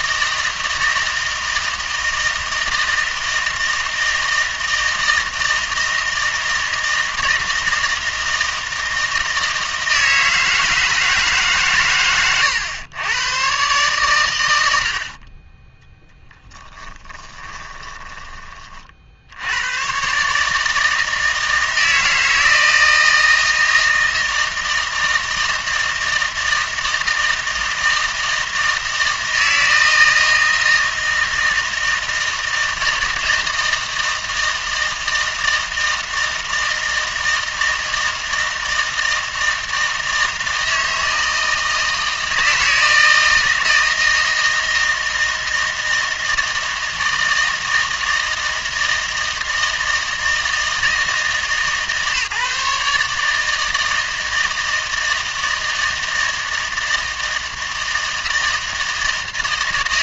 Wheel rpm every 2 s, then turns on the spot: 160, 160, 160, 160, 160, 160, 120, 90, 10, 30, 150, 160, 160, 160, 160, 160, 160, 160, 160, 160, 160, 160, 160, 160, 160, 160, 150, 160, 160, 160.
16-18